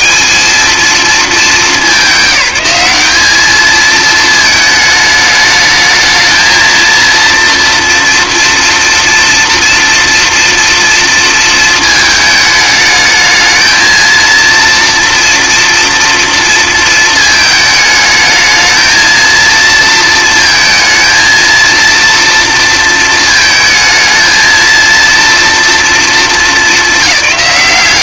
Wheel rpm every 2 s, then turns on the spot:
220, 190, 220, 230, 230, 230, 210, 230, 220, 220, 230, 230, 230, 210.
none